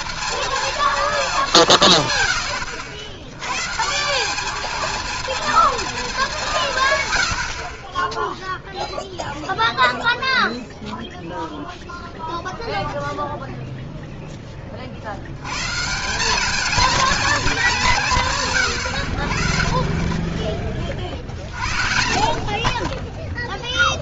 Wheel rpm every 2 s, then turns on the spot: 150, 170, 220, 10, 0, 0, 0, 170, 190, 30, 60, 0.
none